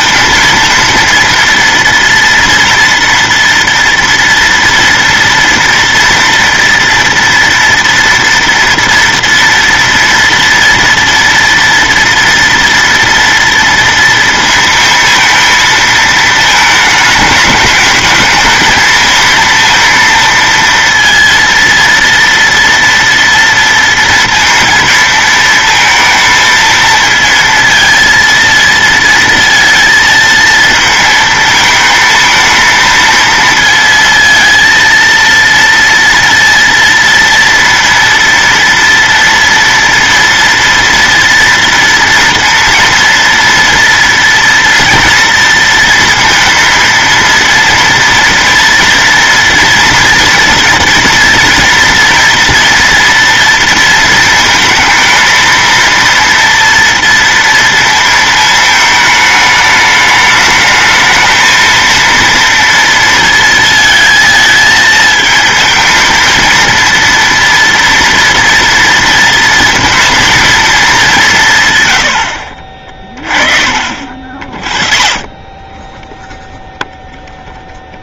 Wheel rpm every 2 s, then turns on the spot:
230, 240, 230, 230, 230, 230, 230, 230, 220, 220, 230, 230, 230, 230, 230, 220, 220, 230, 230, 230, 230, 230, 230, 230, 230, 240, 240, 220, 230, 220, 210, 230, 220, 230, 230, 220, 40, 30, 0.
72-74